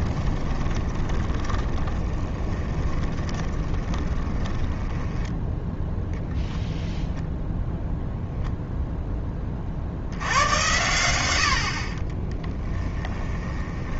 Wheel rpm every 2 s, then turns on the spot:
20, 20, 10, 0, 0, 100, 10.
0-6 12-14